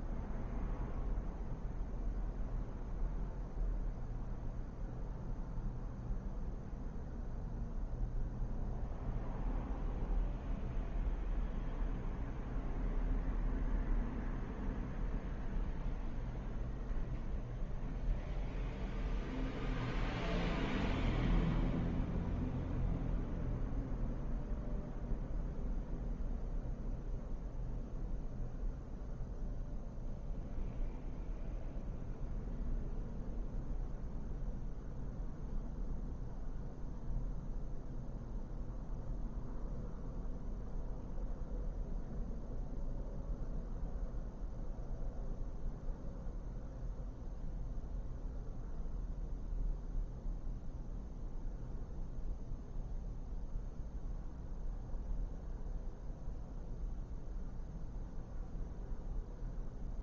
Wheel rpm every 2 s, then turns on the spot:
0, 0, 0, 0, 0, 0, 0, 0, 0, 0, 0, 0, 0, 0, 0, 0, 0, 0, 0, 0, 0, 0, 0, 0, 0, 0, 0, 0, 0, 0.
none